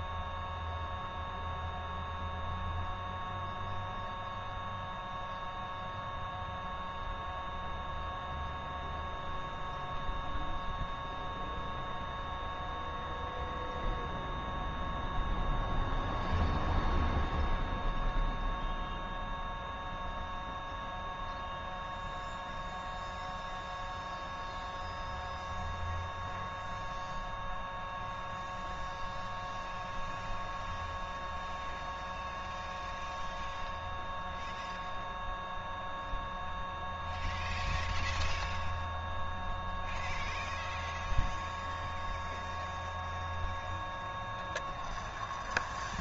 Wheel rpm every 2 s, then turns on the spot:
0, 0, 0, 0, 0, 0, 0, 0, 0, 0, 0, 0, 0, 0, 0, 0, 0, 0, 0, 0, 0, 0, 0.
none